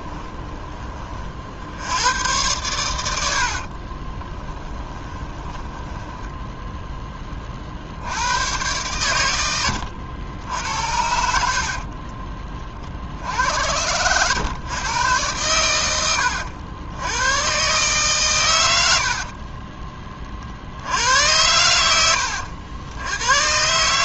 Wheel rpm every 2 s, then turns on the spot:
30, 100, 20, 10, 100, 80, 60, 110, 90, 70, 80, 90.
4-6 10-12